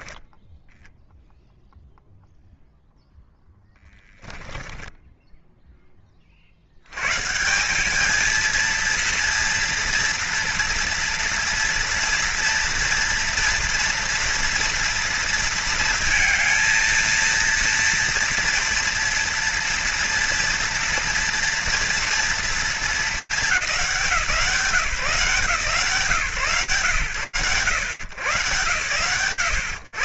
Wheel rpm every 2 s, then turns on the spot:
0, 0, 10, 150, 230, 230, 240, 230, 230, 230, 240, 220, 140, 120, 120.
none